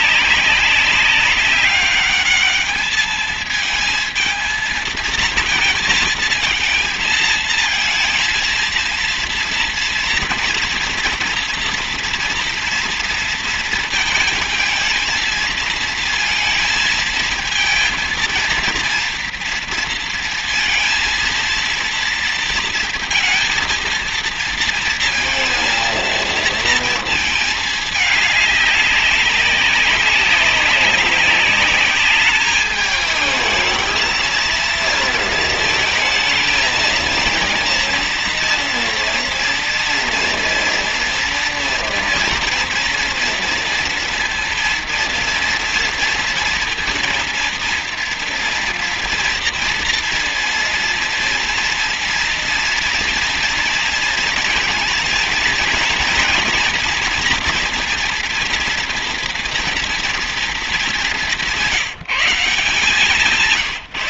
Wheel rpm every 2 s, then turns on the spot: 190, 210, 220, 220, 230, 230, 230, 220, 220, 230, 230, 230, 230, 230, 200, 190, 210, 230, 220, 230, 230, 240, 230, 230, 230, 230, 230, 230, 230, 230, 220, 170.
none